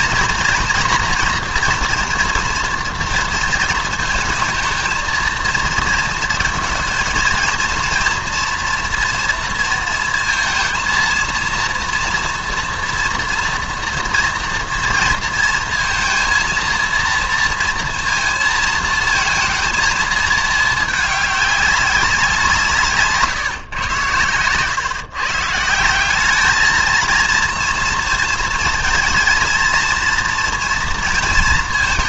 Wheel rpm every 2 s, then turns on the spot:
230, 230, 220, 230, 240, 230, 230, 230, 230, 230, 220, 150, 130, 220, 230, 240.
none